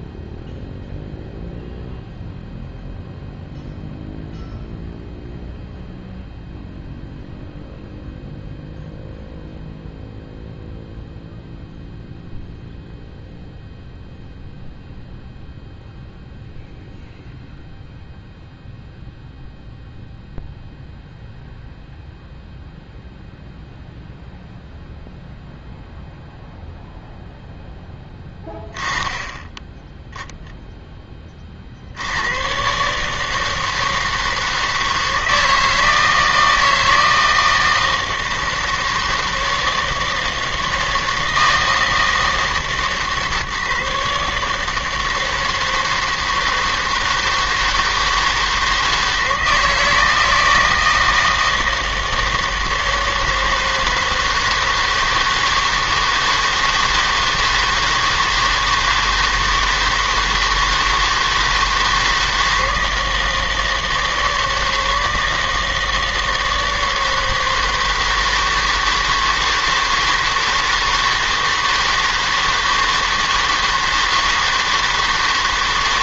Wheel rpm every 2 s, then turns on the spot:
0, 0, 0, 0, 0, 0, 0, 0, 0, 0, 0, 0, 0, 0, 10, 0, 130, 160, 160, 160, 160, 150, 160, 160, 160, 160, 160, 160, 160, 160, 160, 160, 160, 160, 160, 160, 160, 160.
none